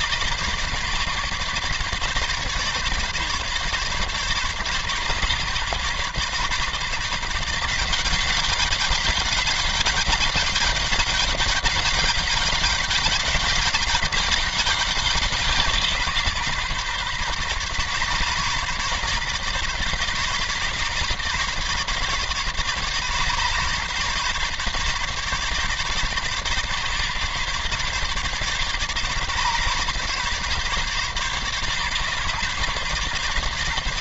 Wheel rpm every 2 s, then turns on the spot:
140, 140, 140, 140, 200, 200, 200, 190, 140, 140, 140, 140, 140, 140, 140, 140, 140.
none